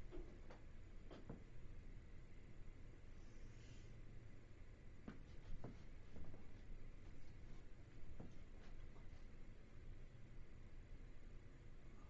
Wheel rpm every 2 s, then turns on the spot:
0, 0, 0, 0, 0, 0.
none